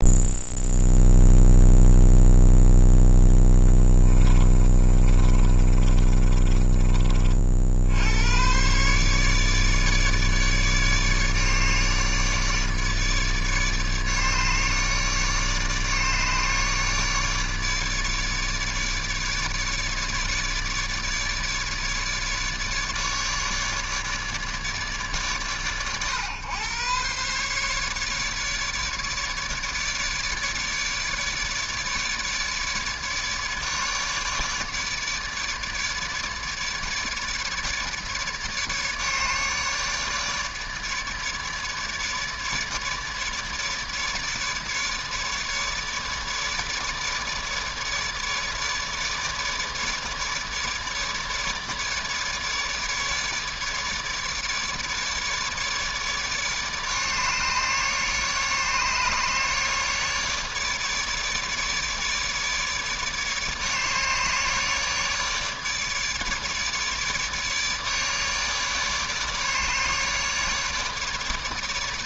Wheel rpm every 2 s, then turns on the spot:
0, 0, 30, 30, 130, 150, 150, 150, 150, 150, 150, 150, 140, 120, 150, 150, 150, 150, 150, 150, 150, 150, 150, 150, 150, 150, 150, 150, 150, 150, 150, 150, 150, 150, 150, 150.
4-6